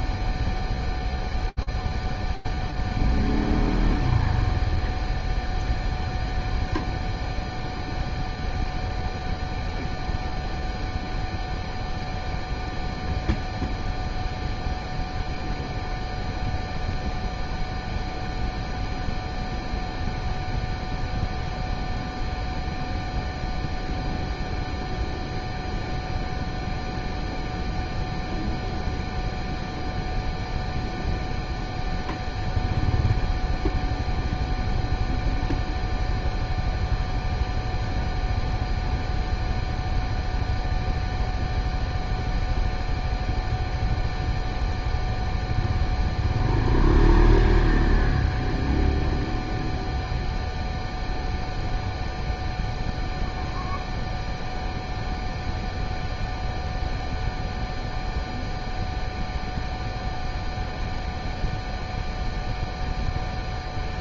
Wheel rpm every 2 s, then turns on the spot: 0, 0, 0, 0, 0, 0, 0, 0, 0, 0, 0, 0, 0, 0, 0, 0, 0, 0, 0, 0, 0, 0, 0, 0, 0, 0, 0, 0, 0, 0, 0, 0.
none